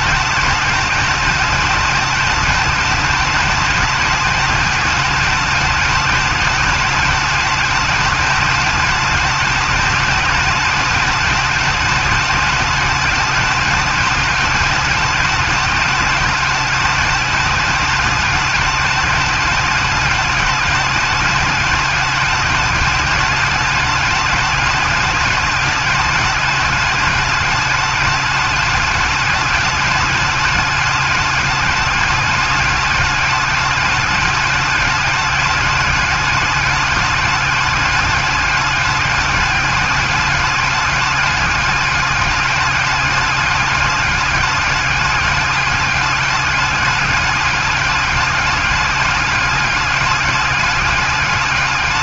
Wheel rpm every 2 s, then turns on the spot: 210, 210, 210, 210, 210, 210, 210, 210, 210, 210, 210, 210, 210, 210, 210, 210, 210, 210, 210, 200, 210, 210, 210, 210, 200, 200.
none